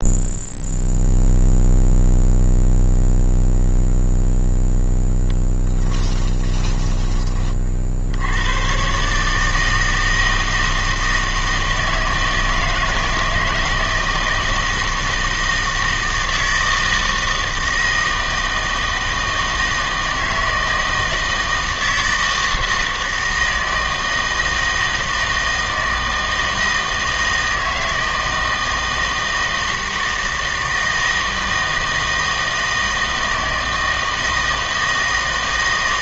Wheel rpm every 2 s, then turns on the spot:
0, 0, 0, 10, 110, 160, 160, 160, 160, 160, 160, 160, 160, 160, 160, 160, 160, 160.
6-8